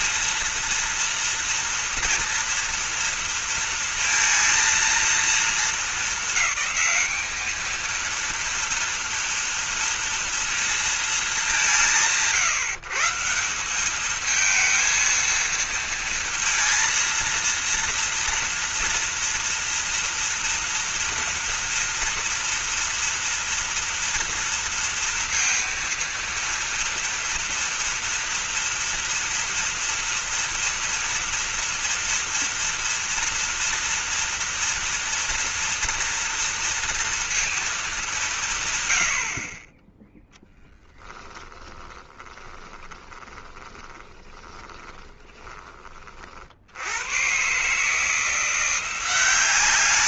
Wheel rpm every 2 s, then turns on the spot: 230, 230, 230, 210, 230, 230, 160, 220, 230, 230, 230, 230, 230, 230, 230, 230, 230, 230, 230, 120, 10, 20, 10, 90, 180.
40-46